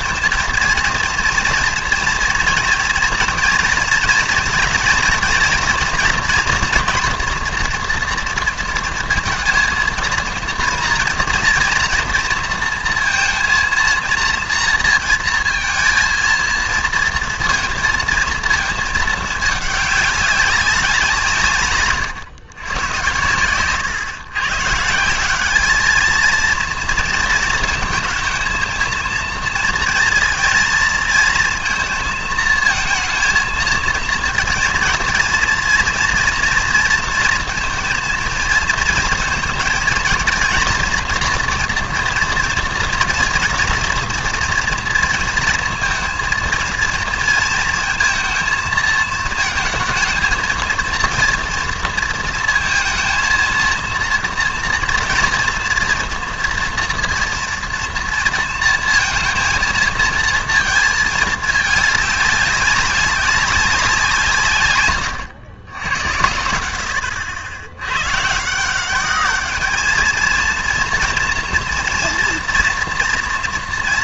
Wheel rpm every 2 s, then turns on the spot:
230, 240, 230, 230, 230, 230, 230, 230, 230, 230, 190, 110, 140, 230, 220, 230, 230, 230, 240, 230, 230, 240, 230, 230, 220, 230, 230, 230, 230, 230, 220, 200, 110, 80, 160, 230, 230.
none